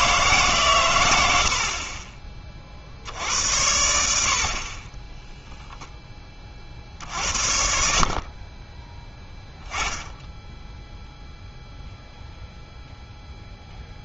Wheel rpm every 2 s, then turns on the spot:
130, 50, 40, 50, 20, 0, 0.
8-10